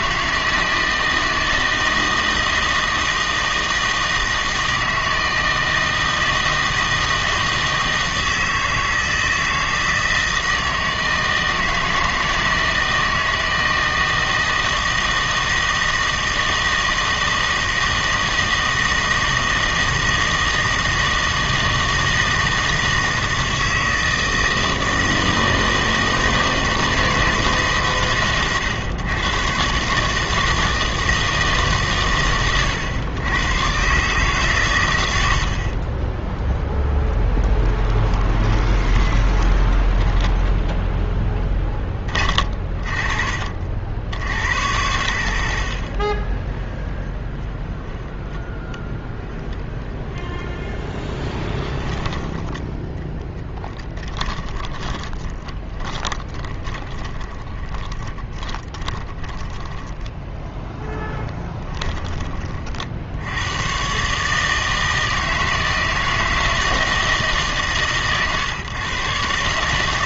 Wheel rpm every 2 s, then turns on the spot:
160, 160, 160, 160, 160, 160, 160, 160, 160, 160, 160, 160, 160, 160, 120, 160, 120, 130, 10, 20, 0, 30, 70, 20, 10, 10, 10, 20, 20, 20, 10, 40, 150, 160, 140.
38-40 46-50 54-60